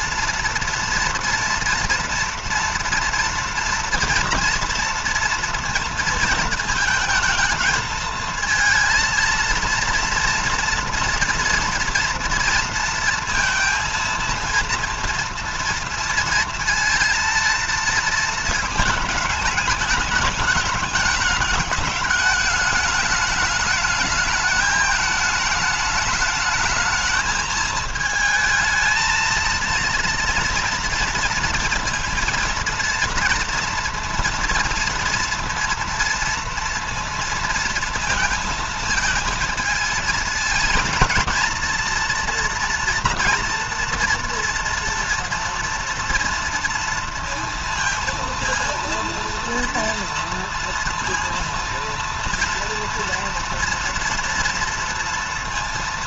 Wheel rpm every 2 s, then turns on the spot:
230, 230, 240, 220, 230, 230, 230, 230, 230, 220, 210, 210, 210, 210, 220, 230, 230, 230, 230, 230, 230, 230, 230, 230, 230, 230, 230, 230.
none